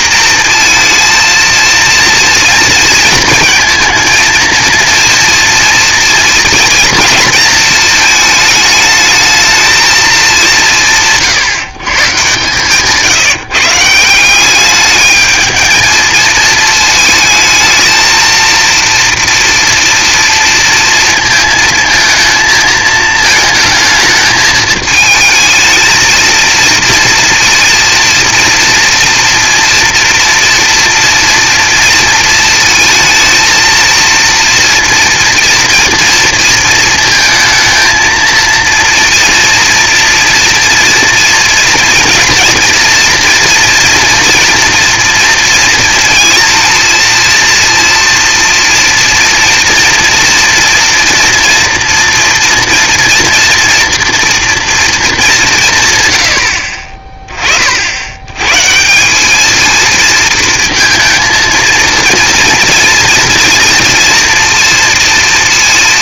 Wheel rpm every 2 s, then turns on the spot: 230, 230, 230, 230, 210, 180, 130, 190, 220, 230, 230, 220, 220, 230, 230, 230, 220, 230, 230, 230, 230, 230, 230, 230, 230, 230, 230, 240, 70, 130, 230, 230, 230.
none